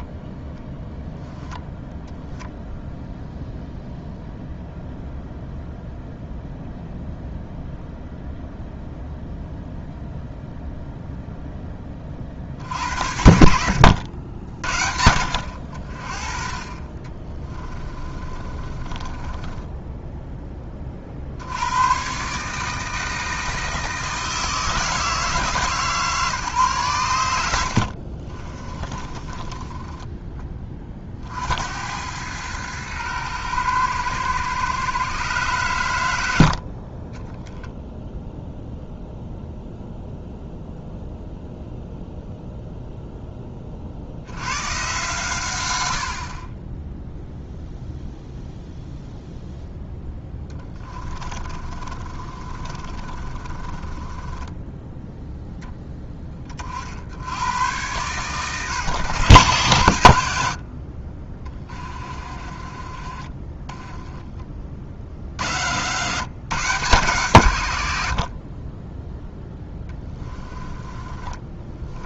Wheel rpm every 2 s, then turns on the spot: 0, 0, 0, 0, 0, 0, 70, 70, 30, 30, 30, 150, 160, 120, 20, 30, 110, 130, 50, 0, 0, 0, 120, 10, 0, 20, 30, 0, 40, 120, 60, 40, 50, 150, 20, 20.
18-20 28-30 50-54 60-62 70-72